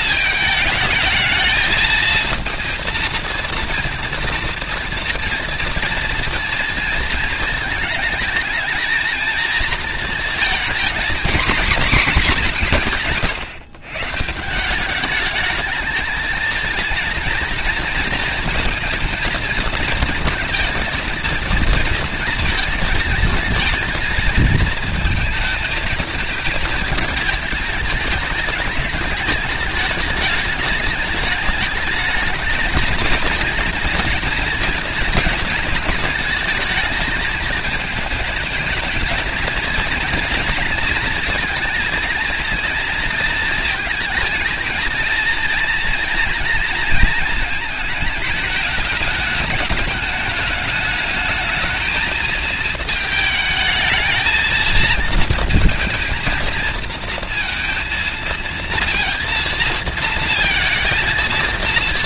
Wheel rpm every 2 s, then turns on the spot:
220, 230, 230, 230, 230, 240, 160, 210, 230, 220, 230, 220, 220, 220, 210, 210, 230, 230, 220, 220, 230, 230, 230, 230, 210, 210, 220, 230, 230, 230, 230.
none